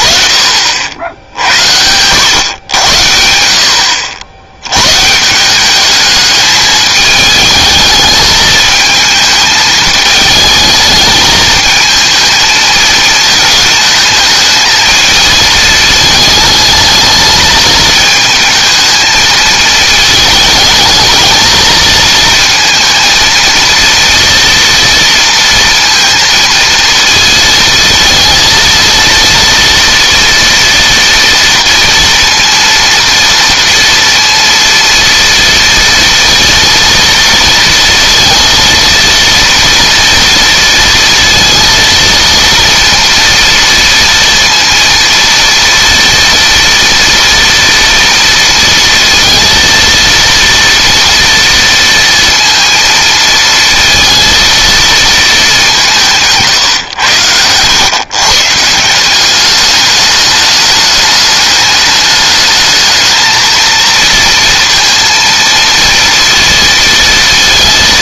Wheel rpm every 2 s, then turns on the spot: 60, 90, 100, 210, 220, 210, 220, 220, 220, 220, 220, 230, 230, 230, 230, 240, 230, 230, 230, 230, 230, 230, 230, 230, 230, 230, 230, 230, 130, 160, 210, 220, 230, 230.
56-58